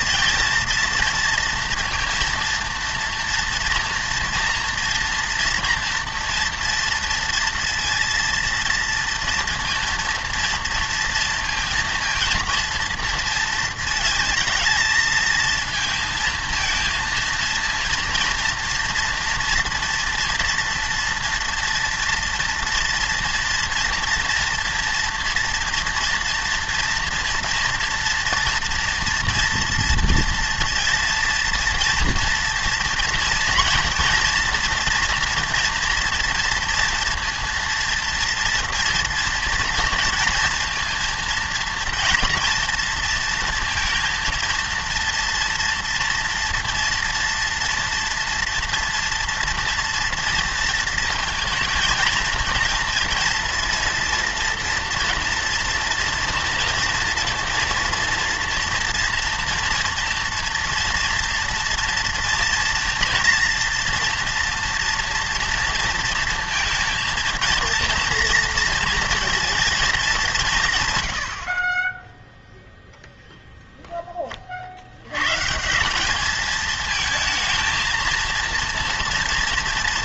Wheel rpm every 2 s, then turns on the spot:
230, 230, 230, 230, 230, 230, 230, 220, 230, 230, 230, 230, 230, 230, 230, 230, 240, 240, 240, 230, 230, 230, 230, 230, 240, 230, 230, 230, 230, 230, 230, 240, 230, 230, 230, 160, 0, 50, 220, 230.
none